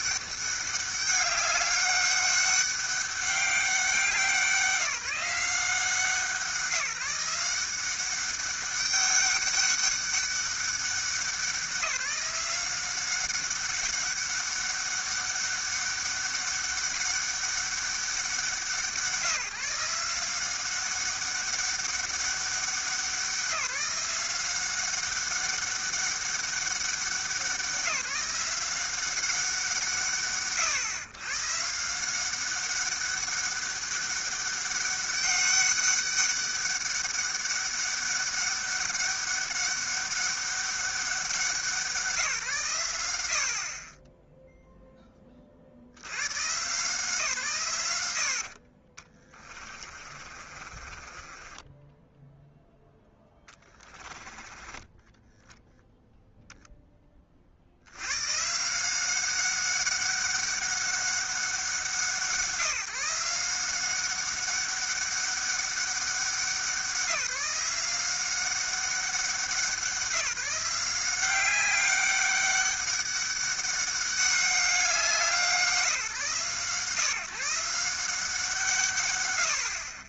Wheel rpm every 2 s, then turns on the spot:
200, 200, 170, 170, 200, 200, 180, 200, 200, 170, 190, 190, 190, 200, 180, 90, 190, 200, 200, 200, 200, 150, 0, 130, 30, 40, 0, 30, 10, 150, 200, 170, 200, 180, 190, 180, 200, 190, 140, 160.
48-52 54-56